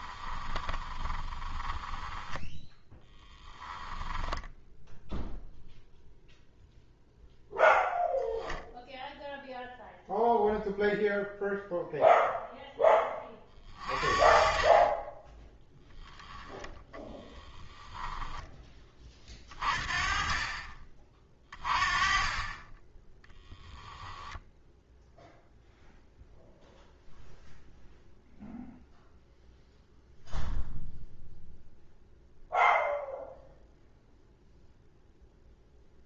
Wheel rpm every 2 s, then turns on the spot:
20, 10, 0, 0, 0, 0, 10, 30, 10, 20, 30, 10, 0, 0, 0, 0, 0, 0.
0-4 16-18